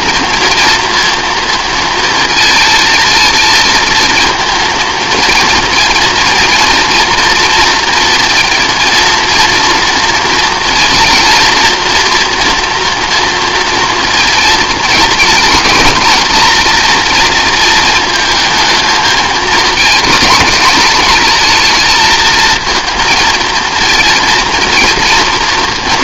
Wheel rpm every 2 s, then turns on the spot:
230, 220, 230, 230, 230, 240, 230, 230, 230, 220, 230, 230, 230.
none